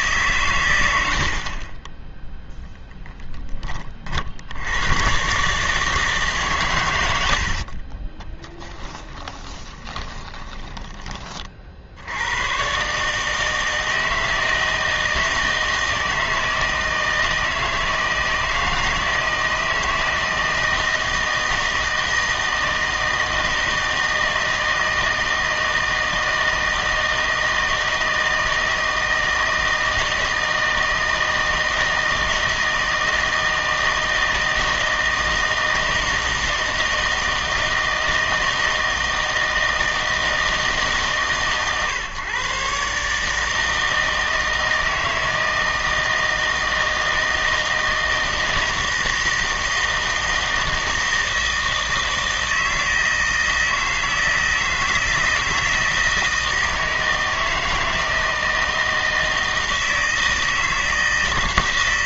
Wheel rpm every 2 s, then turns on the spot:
140, 0, 80, 120, 10, 20, 110, 160, 160, 160, 160, 160, 160, 160, 160, 160, 160, 160, 160, 160, 160, 140, 160, 160, 160, 160, 160, 160, 160, 160, 160.
8-12